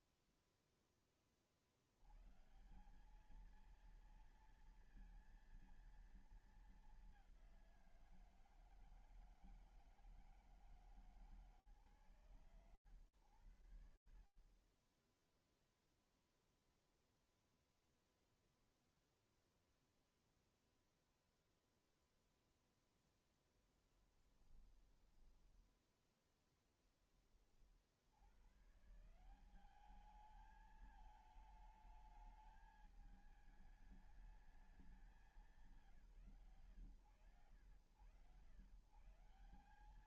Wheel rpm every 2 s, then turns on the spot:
0, 140, 230, 210, 160, 160, 120, 20, 0, 0, 0, 10, 10, 40, 190, 220, 210, 140, 110, 180.
22-26